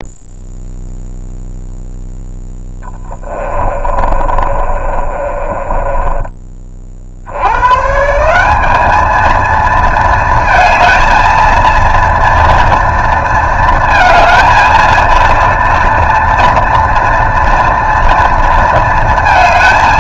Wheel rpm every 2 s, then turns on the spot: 0, 10, 30, 30, 210, 230, 230, 230, 230, 230.
2-6